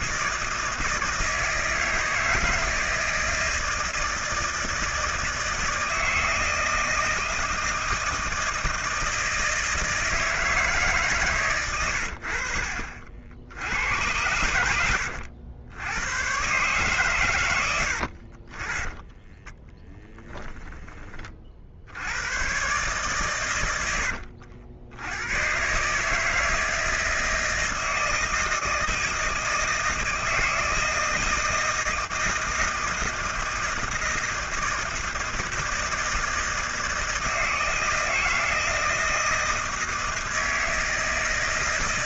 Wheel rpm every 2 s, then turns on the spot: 160, 160, 160, 160, 160, 150, 50, 90, 130, 20, 20, 130, 100, 160, 160, 160, 160, 160, 160, 160, 160.
18-20